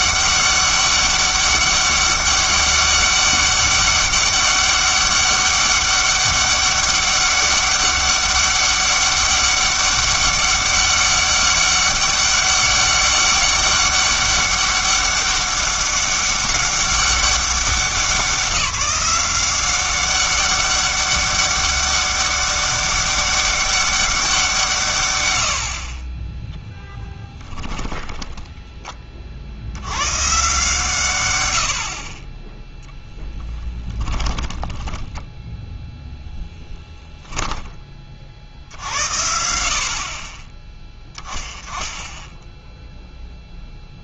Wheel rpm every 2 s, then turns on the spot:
200, 200, 200, 200, 200, 200, 200, 200, 200, 190, 200, 200, 150, 0, 20, 140, 0, 10, 10, 70, 10, 0.
34-36